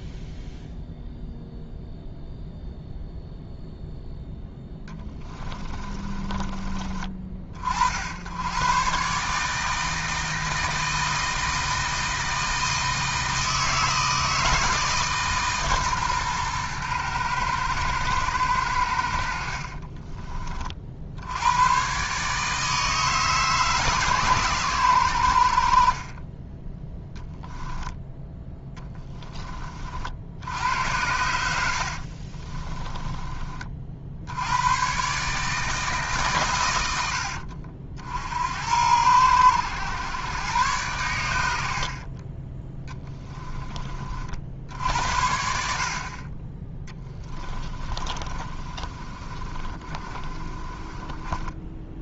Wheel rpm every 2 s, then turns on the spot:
0, 0, 10, 30, 120, 160, 160, 150, 120, 80, 50, 150, 100, 10, 10, 90, 30, 100, 100, 90, 100, 10, 70, 20, 30, 20.
4-6 32-34 42-44 46-52